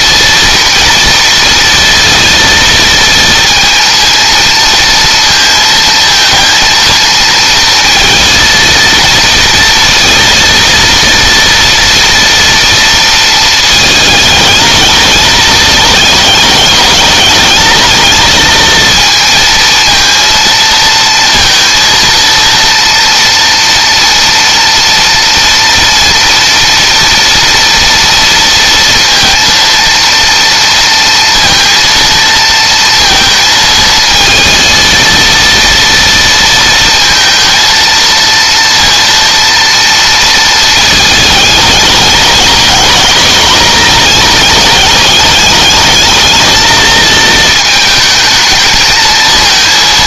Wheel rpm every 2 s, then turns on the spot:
230, 230, 230, 230, 230, 230, 230, 210, 210, 220, 230, 230, 230, 230, 230, 230, 230, 230, 230, 230, 220, 220, 210, 220, 220.
none